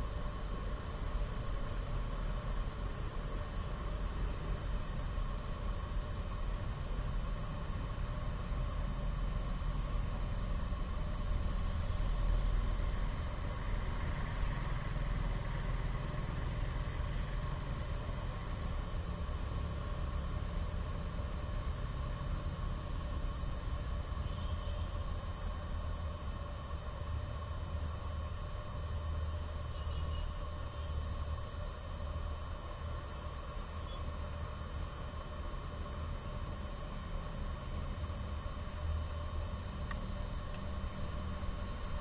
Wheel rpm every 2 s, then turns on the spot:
0, 0, 0, 0, 0, 0, 0, 0, 0, 0, 0, 0, 0, 0, 0, 0, 0, 0, 0, 0, 0.
none